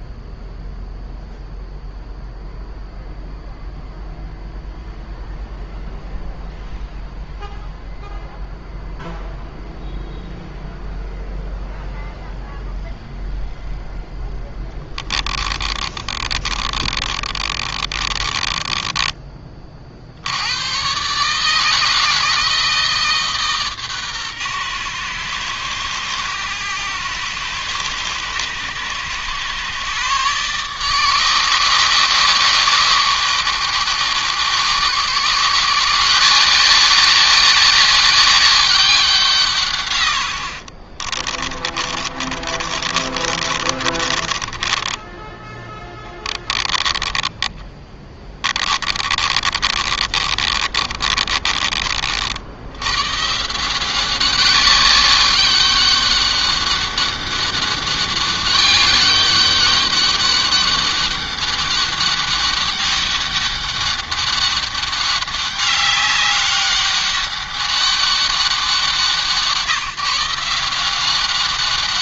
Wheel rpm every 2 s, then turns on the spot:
0, 0, 0, 0, 0, 0, 0, 10, 30, 20, 100, 160, 120, 110, 110, 140, 120, 120, 180, 200, 70, 40, 20, 20, 30, 30, 90, 190, 200, 200, 200, 200, 200, 200, 190, 170.
14-20 40-52